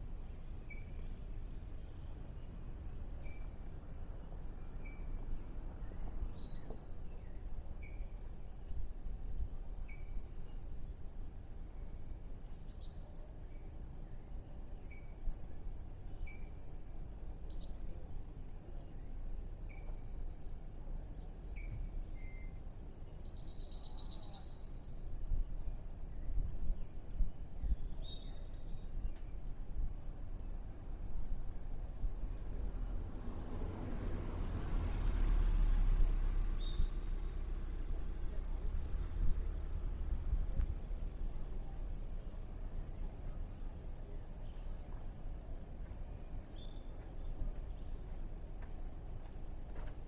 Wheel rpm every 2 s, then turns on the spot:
0, 0, 0, 0, 0, 0, 0, 0, 0, 0, 0, 0, 0, 0, 0, 0, 0, 0, 0, 0, 0, 0, 0, 0, 0.
none